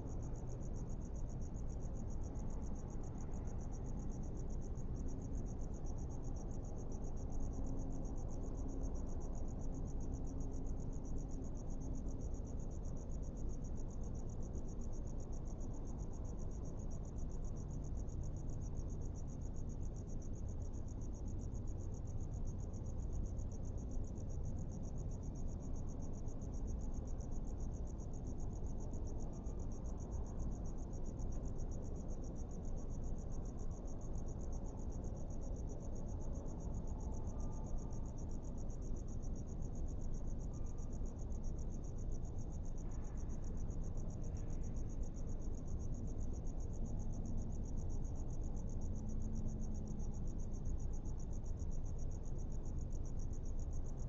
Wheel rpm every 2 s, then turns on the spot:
0, 0, 0, 0, 0, 0, 0, 0, 0, 0, 0, 0, 0, 0, 0, 0, 0, 0, 0, 0, 0, 0, 0, 0, 0, 0, 0.
none